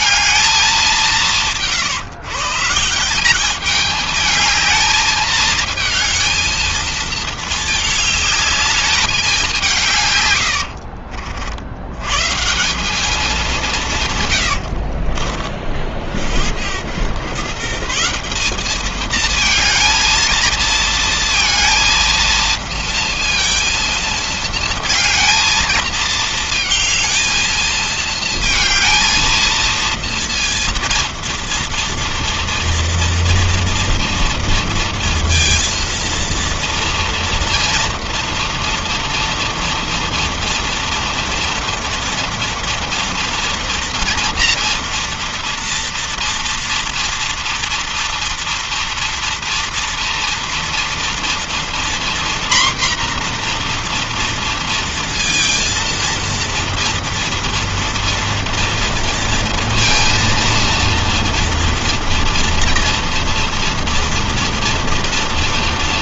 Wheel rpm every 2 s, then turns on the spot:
210, 150, 220, 220, 210, 100, 160, 90, 80, 200, 230, 230, 230, 230, 220, 230, 230, 230, 230, 230, 230, 230, 230, 230, 230, 230, 240, 230, 230, 230, 230, 230, 230.
10-12 14-16